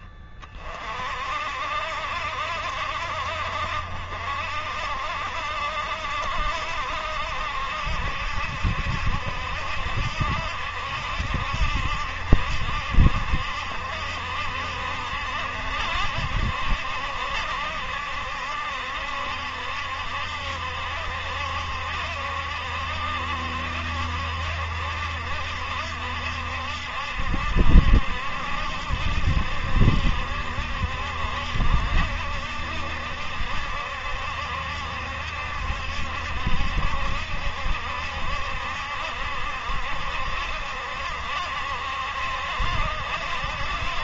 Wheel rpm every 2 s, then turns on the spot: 40, 60, 60, 70, 70, 70, 60, 70, 70, 70, 70, 70, 70, 70, 70, 70, 70, 70, 70, 70, 70, 70.
none